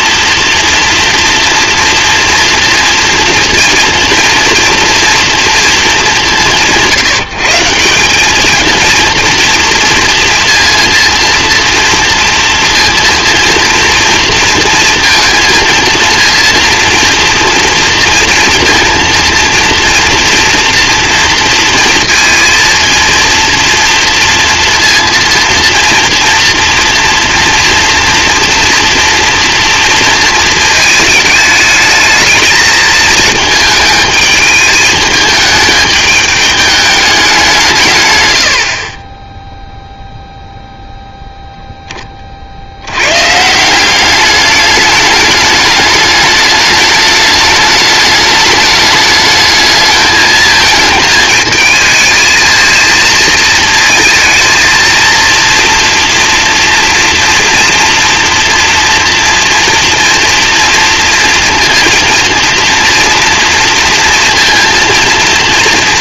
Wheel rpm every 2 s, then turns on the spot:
230, 230, 230, 170, 230, 230, 230, 230, 230, 230, 230, 230, 230, 230, 230, 220, 220, 220, 210, 60, 0, 70, 210, 210, 210, 220, 230, 230, 230, 230, 230, 230, 230.
none